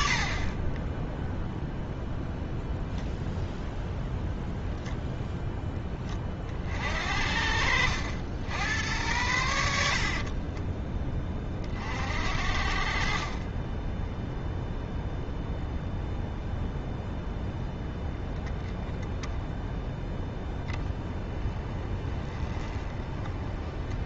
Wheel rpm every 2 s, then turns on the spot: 10, 0, 0, 40, 90, 20, 40, 0, 0, 0, 10, 20.
10-12